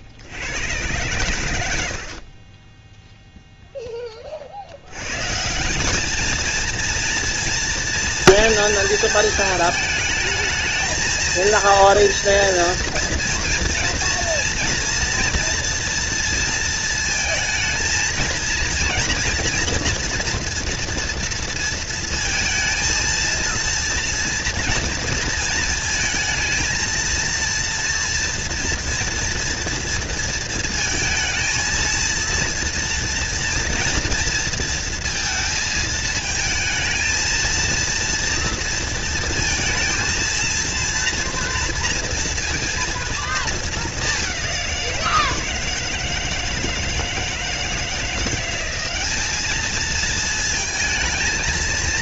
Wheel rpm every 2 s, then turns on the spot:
120, 10, 90, 230, 230, 230, 230, 230, 230, 230, 230, 230, 230, 220, 230, 220, 230, 230, 220, 230, 230, 230, 180, 160, 200, 220.
none